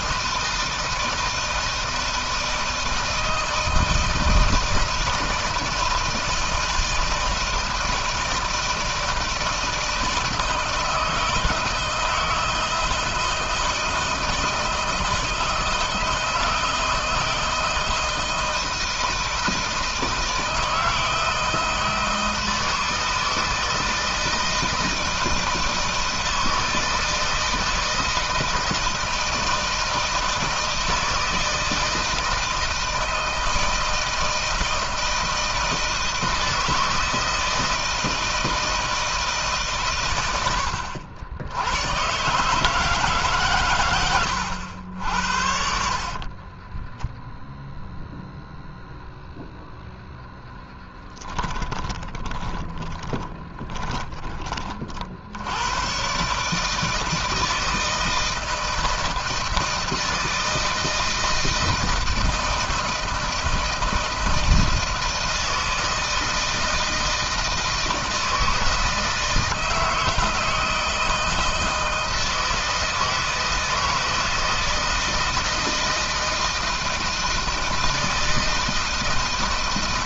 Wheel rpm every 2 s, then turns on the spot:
160, 160, 160, 160, 160, 160, 160, 160, 160, 160, 160, 160, 160, 160, 160, 170, 160, 160, 160, 160, 80, 150, 90, 20, 0, 10, 30, 30, 150, 160, 160, 160, 160, 160, 160, 160, 160, 160, 160, 160.
46-48 50-54